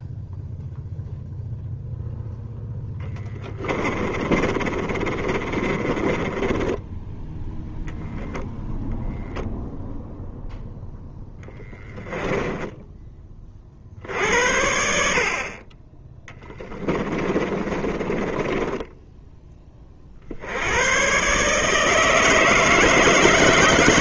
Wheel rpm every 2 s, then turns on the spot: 0, 10, 20, 20, 0, 0, 10, 70, 20, 20, 80, 160.
2-8 12-14 16-20